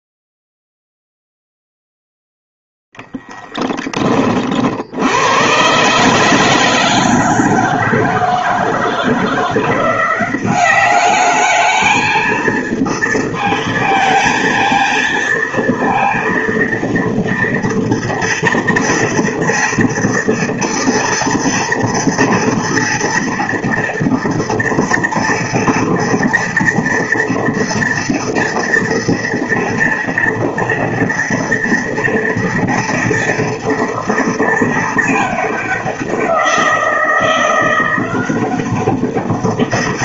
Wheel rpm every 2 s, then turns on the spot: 0, 0, 70, 160, 160, 200, 230, 230, 230, 230, 230, 240, 230, 230, 230, 230, 240, 220, 170, 190.
none